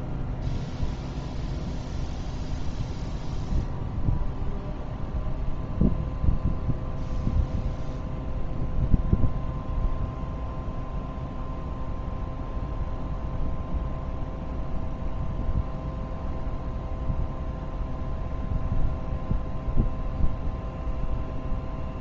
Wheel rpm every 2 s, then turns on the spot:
0, 0, 0, 0, 0, 0, 0, 0, 0, 0, 0.
none